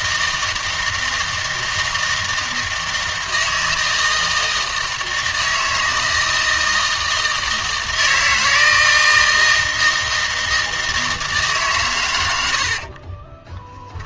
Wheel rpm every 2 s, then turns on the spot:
160, 160, 160, 160, 160, 160, 60.
12-14